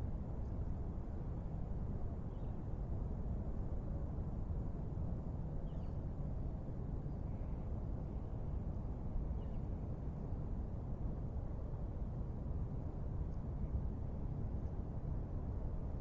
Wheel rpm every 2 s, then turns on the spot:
0, 0, 0, 0, 0, 0, 0, 0.
none